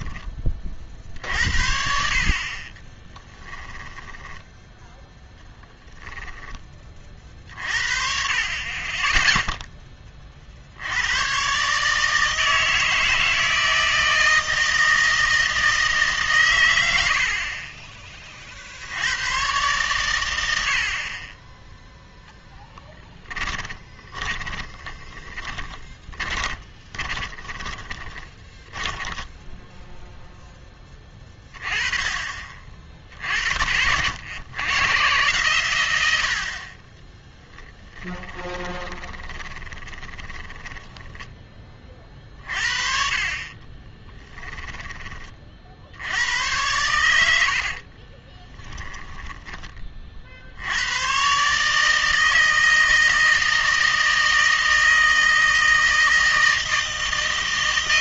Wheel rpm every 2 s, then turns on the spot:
40, 30, 10, 20, 30, 60, 160, 160, 110, 60, 70, 10, 10, 20, 20, 10, 50, 120, 30, 20, 20, 40, 10, 110, 10, 90, 160, 160, 160.
2-4 22-30 38-42 48-50